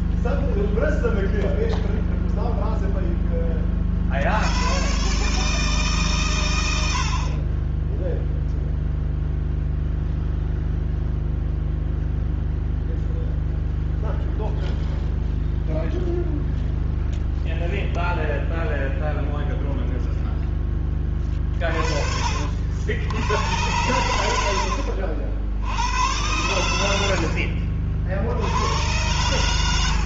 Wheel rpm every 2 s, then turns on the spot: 0, 10, 130, 60, 0, 0, 0, 0, 0, 0, 20, 90, 70, 90, 110.
none